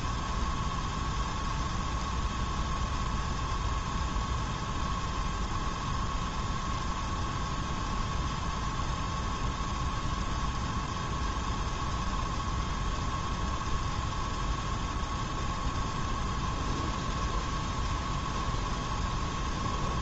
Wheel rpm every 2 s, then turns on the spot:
0, 0, 0, 0, 0, 0, 0, 0, 0, 0.
none